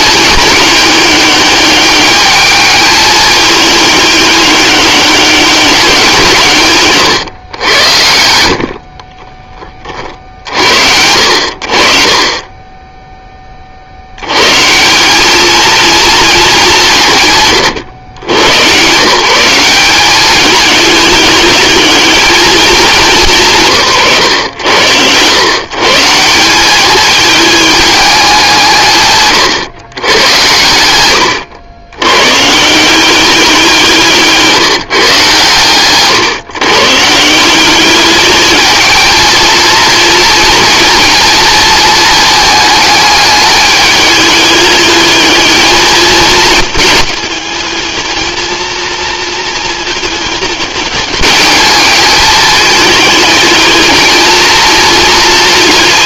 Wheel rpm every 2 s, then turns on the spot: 210, 210, 200, 140, 40, 60, 10, 170, 170, 140, 210, 200, 100, 210, 160, 100, 180, 150, 150, 220, 230, 210, 210, 210, 230, 210, 220, 230.
8-10